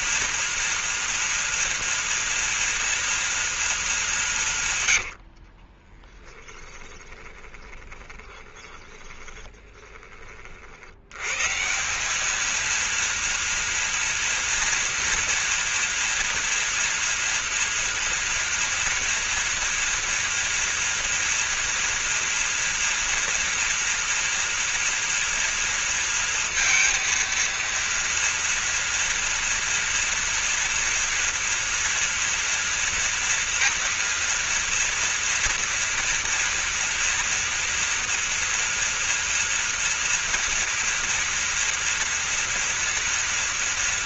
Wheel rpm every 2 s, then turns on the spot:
230, 230, 130, 20, 20, 80, 230, 230, 230, 230, 230, 230, 240, 230, 230, 240, 230, 230, 230, 230, 240, 240.
4-10